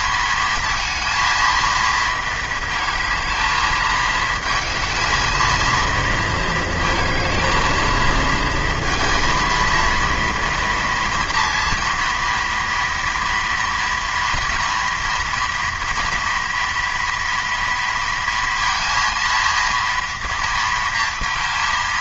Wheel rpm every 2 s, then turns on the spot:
230, 220, 220, 220, 230, 230, 230, 230, 230, 230, 230.
none